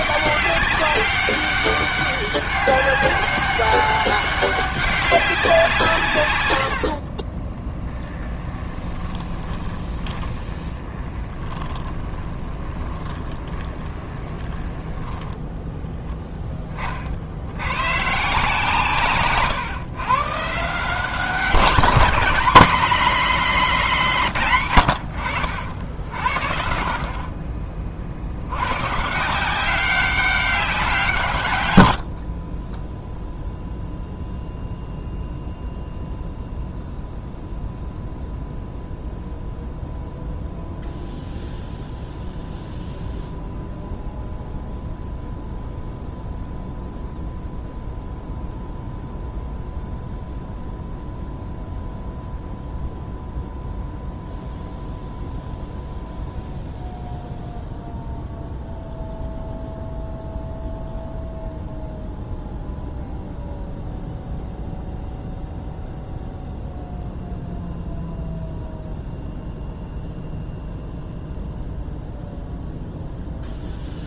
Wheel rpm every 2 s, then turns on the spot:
200, 200, 200, 100, 20, 20, 20, 20, 10, 150, 150, 200, 120, 50, 100, 190, 20, 0, 0, 0, 0, 0, 0, 0, 0, 0, 0, 0, 0, 0, 0, 0, 0, 0, 0, 0, 0.
6-16 32-34